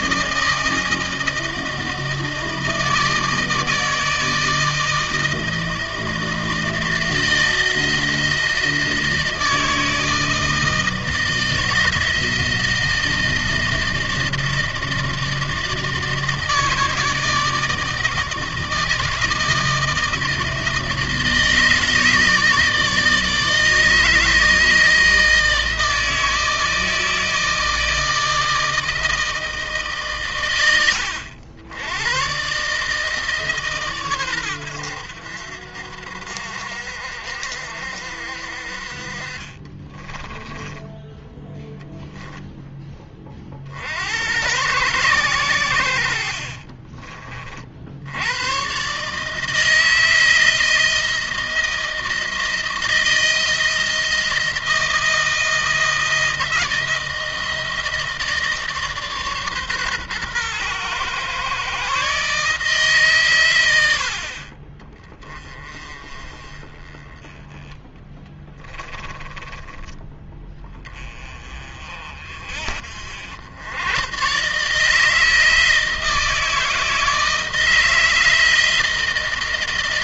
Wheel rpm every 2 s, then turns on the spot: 160, 160, 160, 160, 160, 160, 160, 160, 160, 160, 160, 160, 160, 160, 160, 100, 150, 90, 60, 50, 10, 20, 110, 40, 130, 160, 160, 160, 160, 150, 120, 140, 20, 20, 10, 30, 60, 150, 160, 160.
40-42 46-48 68-70